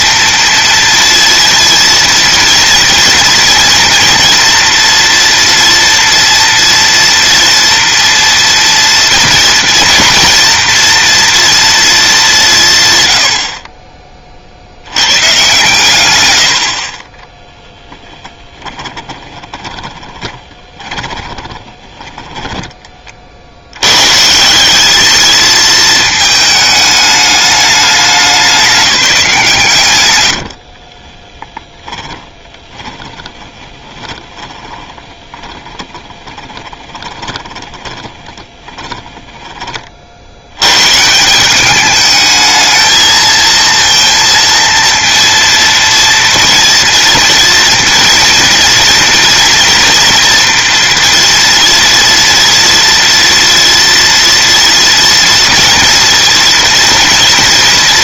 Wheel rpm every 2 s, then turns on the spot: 230, 230, 240, 230, 230, 240, 130, 90, 40, 20, 20, 20, 200, 210, 190, 50, 20, 20, 20, 10, 120, 220, 230, 230, 240, 240, 230, 230, 230.
18-22 30-40